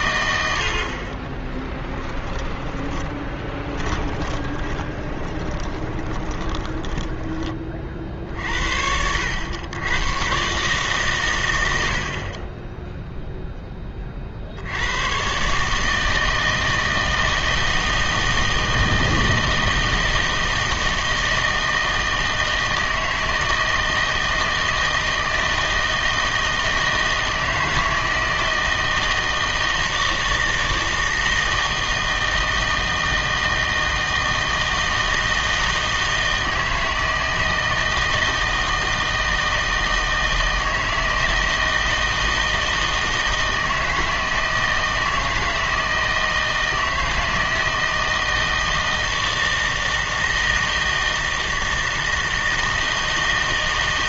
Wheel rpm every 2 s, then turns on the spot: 70, 10, 30, 10, 70, 140, 10, 70, 160, 160, 160, 160, 160, 160, 160, 160, 160, 160, 160, 160, 160, 160, 160, 160, 160, 160, 160.
2-8